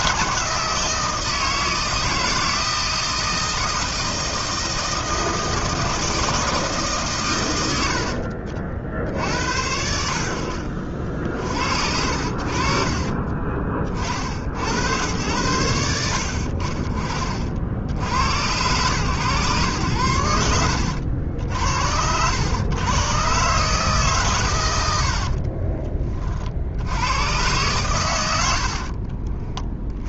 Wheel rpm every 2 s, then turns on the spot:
160, 160, 160, 150, 60, 50, 40, 90, 50, 120, 80, 110, 90, 80, 50.
12-14 24-26 28-30